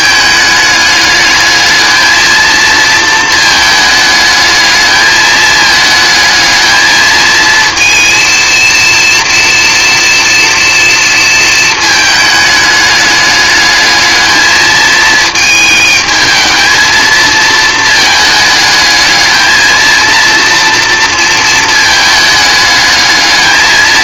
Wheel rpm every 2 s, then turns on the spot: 210, 230, 220, 220, 230, 230, 210, 220, 230, 220, 230, 210.
none